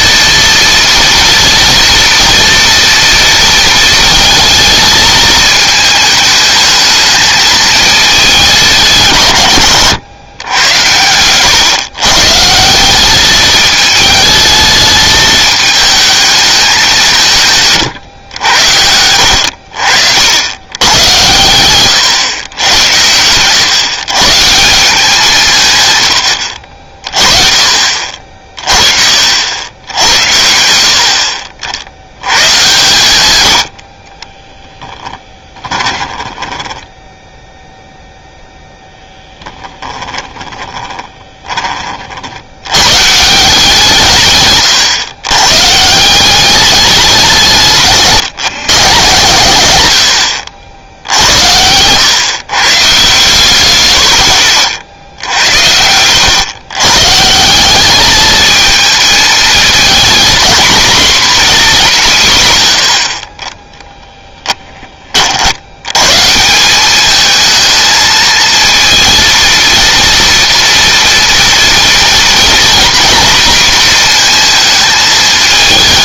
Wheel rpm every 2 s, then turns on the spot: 230, 230, 220, 220, 170, 110, 160, 220, 210, 90, 100, 100, 160, 70, 50, 70, 120, 10, 10, 0, 20, 100, 130, 200, 150, 80, 130, 70, 120, 220, 230, 100, 10, 190, 230, 230, 240, 220.
34-38 40-42